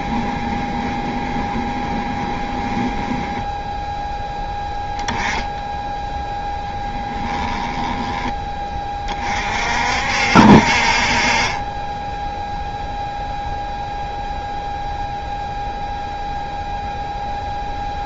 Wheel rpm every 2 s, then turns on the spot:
20, 10, 10, 10, 30, 50, 0, 0, 0.
0-4 6-8